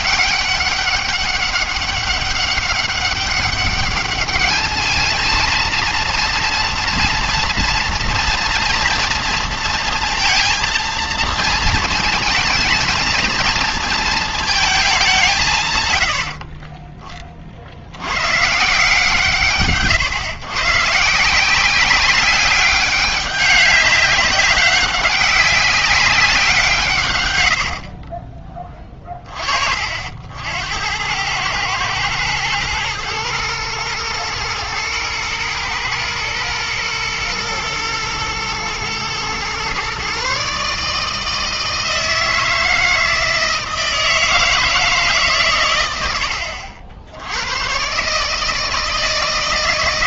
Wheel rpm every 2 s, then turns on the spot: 200, 200, 210, 230, 230, 230, 230, 220, 40, 140, 130, 200, 190, 170, 20, 70, 110, 110, 120, 120, 140, 160, 160, 80, 160.
16-18